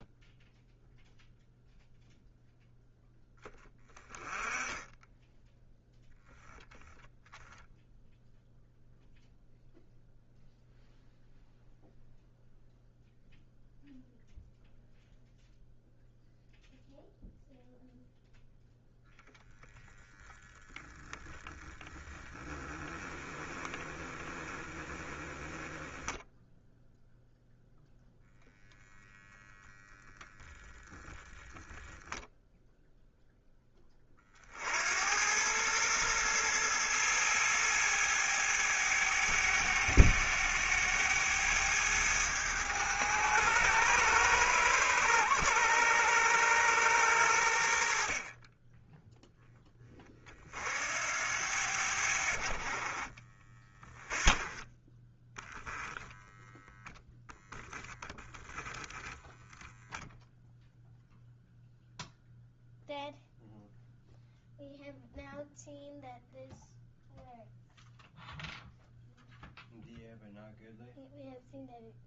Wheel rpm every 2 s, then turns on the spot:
0, 0, 10, 0, 0, 0, 0, 0, 0, 0, 0, 10, 10, 0, 0, 0, 0, 80, 110, 100, 100, 110, 100, 90, 10, 70, 40, 20, 0, 20, 0, 0, 0, 0, 0, 0.
22-26